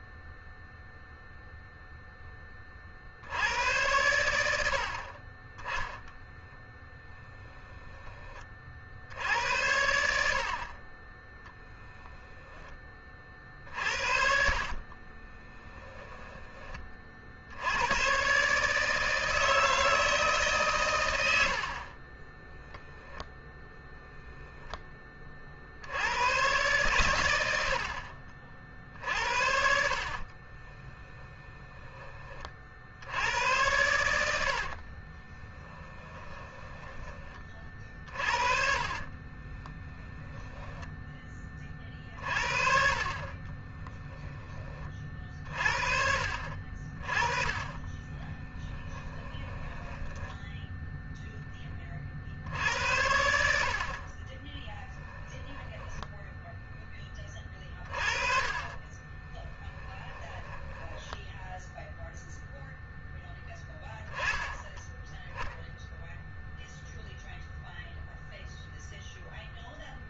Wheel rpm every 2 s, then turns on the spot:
0, 20, 80, 10, 40, 50, 20, 40, 20, 140, 130, 10, 10, 110, 60, 30, 40, 70, 20, 40, 10, 40, 30, 40, 30, 10, 70, 20, 10, 30, 10, 0, 10, 0, 0.
6-8 12-16 30-32 34-40 48-50 54-56 58-62